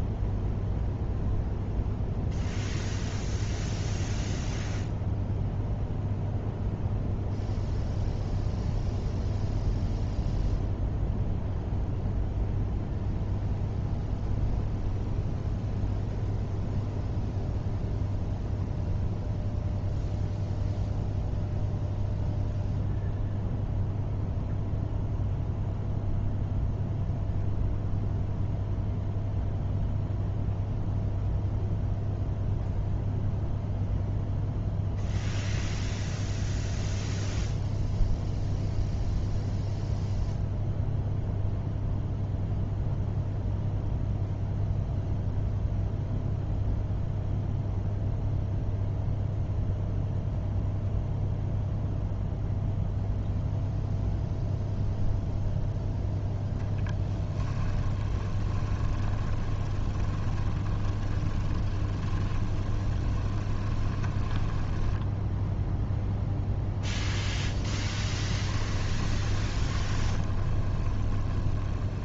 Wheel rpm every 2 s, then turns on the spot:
0, 0, 0, 0, 0, 0, 0, 0, 0, 0, 0, 0, 0, 0, 0, 0, 0, 0, 0, 0, 0, 0, 0, 0, 0, 0, 0, 0, 10, 20, 20, 20, 10, 0, 10, 30.
56-66 68-72